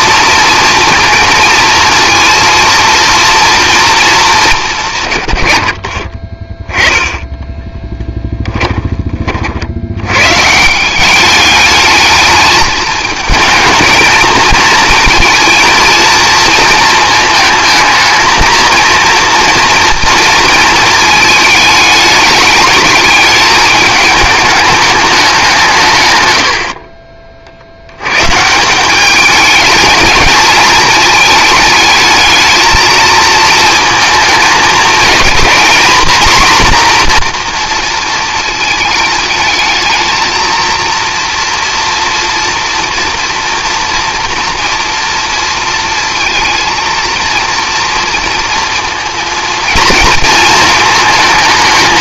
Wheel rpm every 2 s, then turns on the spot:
230, 230, 180, 20, 10, 160, 210, 230, 220, 220, 230, 220, 210, 60, 180, 220, 220, 220, 250, 220, 230, 230, 230, 230, 230, 220.
none